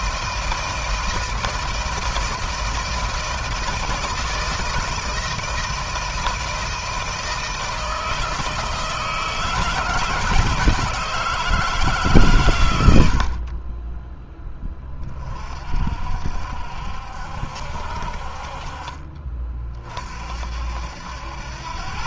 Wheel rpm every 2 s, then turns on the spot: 160, 160, 160, 160, 160, 170, 110, 10, 60, 50, 60.
none